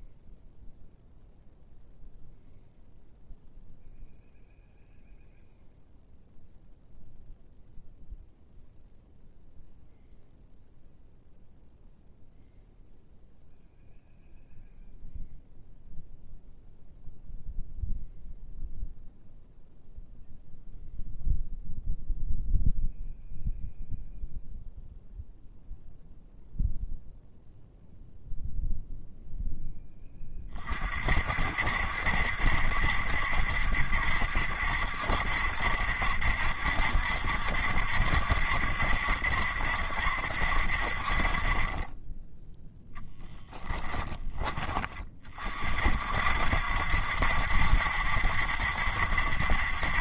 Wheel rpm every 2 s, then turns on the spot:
0, 0, 0, 0, 0, 0, 0, 0, 0, 0, 0, 0, 0, 0, 0, 30, 70, 70, 70, 70, 60, 10, 20, 70, 70.
none